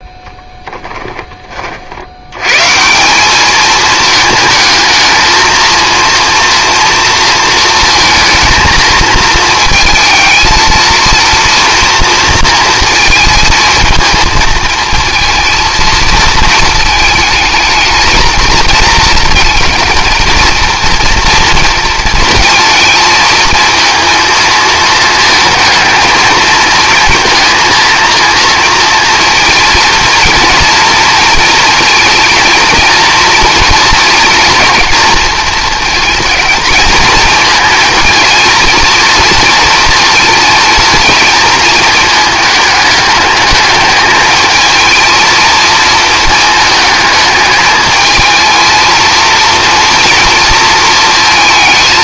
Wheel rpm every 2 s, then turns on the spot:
10, 160, 220, 230, 230, 230, 230, 230, 220, 230, 230, 230, 220, 230, 230, 230, 230, 230, 220, 230, 230, 220, 220, 220, 230, 230.
none